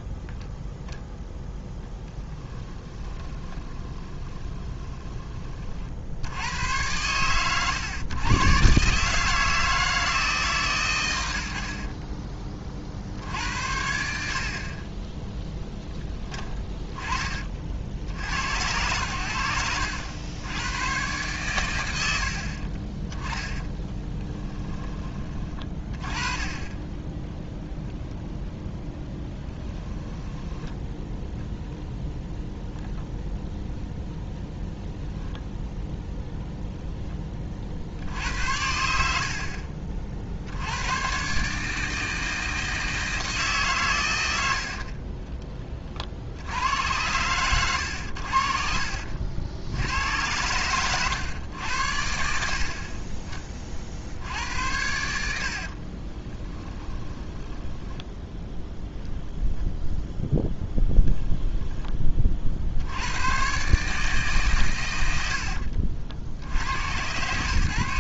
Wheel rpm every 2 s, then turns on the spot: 10, 20, 20, 100, 130, 130, 50, 40, 20, 90, 110, 40, 20, 10, 10, 10, 0, 0, 0, 70, 90, 160, 60, 90, 50, 110, 50, 80, 20, 0, 10, 70, 110, 100.
2-6 30-32 48-50 54-58